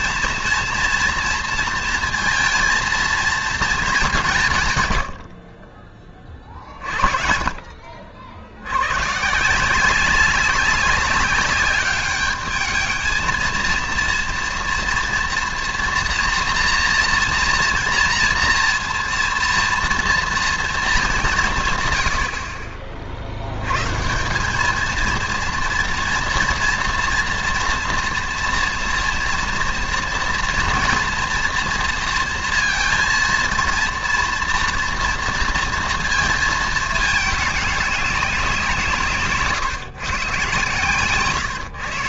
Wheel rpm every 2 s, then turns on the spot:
230, 230, 120, 40, 80, 200, 210, 230, 230, 230, 230, 50, 210, 230, 240, 230, 230, 230, 220, 180, 130.
none